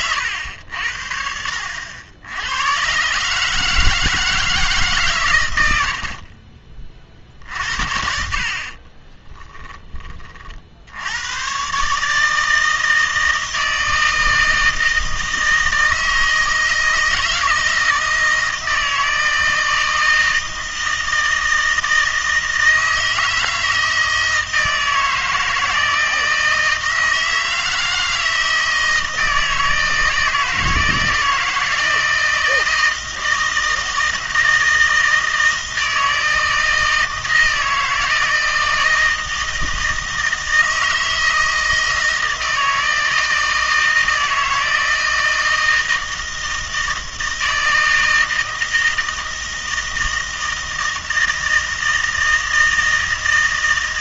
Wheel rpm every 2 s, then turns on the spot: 80, 110, 160, 40, 40, 60, 160, 160, 160, 160, 160, 160, 160, 160, 160, 160, 160, 160, 160, 160, 160, 160, 160, 160, 160, 160, 160.
8-10